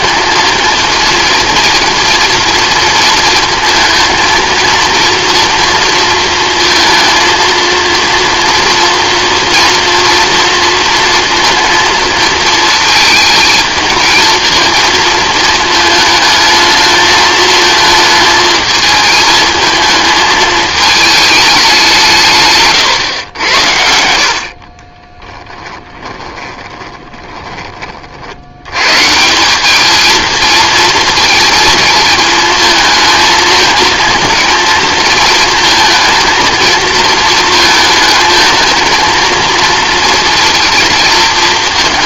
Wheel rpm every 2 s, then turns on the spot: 230, 230, 230, 230, 230, 230, 220, 230, 220, 220, 220, 130, 40, 20, 110, 220, 220, 230, 220, 220, 230.
24-28